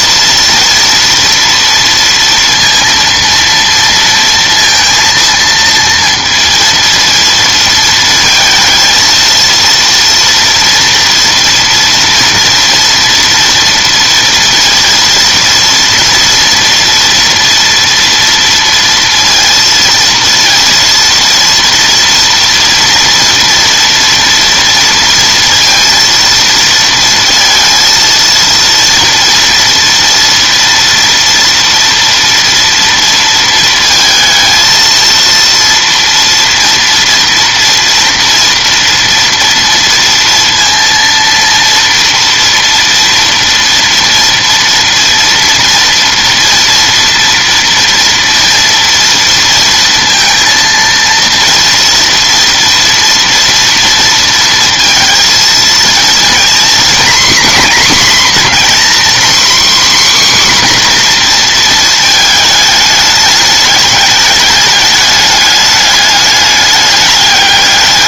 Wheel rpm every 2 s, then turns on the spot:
230, 230, 230, 230, 220, 230, 230, 230, 230, 230, 230, 230, 230, 230, 230, 230, 230, 220, 230, 230, 230, 230, 230, 230, 230, 230, 230, 230, 250, 260, 260, 210, 200, 210.
none